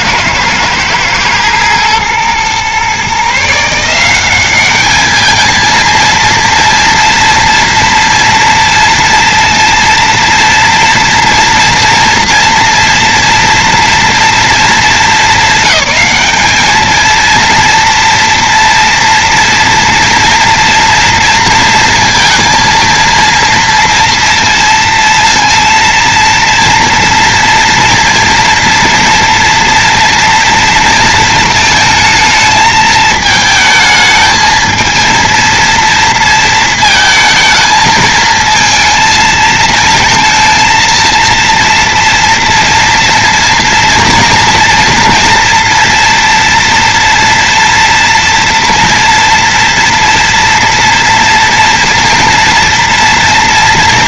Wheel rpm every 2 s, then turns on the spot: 110, 130, 200, 230, 230, 230, 230, 230, 220, 230, 230, 230, 230, 230, 230, 230, 220, 220, 230, 230, 230, 230, 240, 230, 240, 230, 230.
none